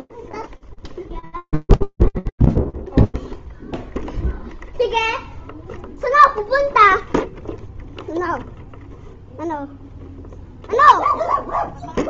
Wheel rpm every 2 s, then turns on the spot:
0, 0, 0, 0, 0, 0.
none